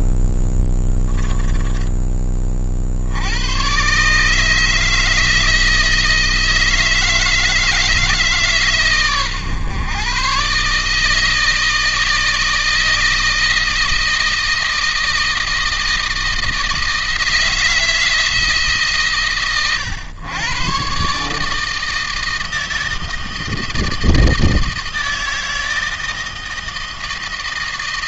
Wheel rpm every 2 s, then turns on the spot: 10, 50, 150, 160, 130, 140, 160, 160, 160, 150, 120, 160, 160, 160.
0-2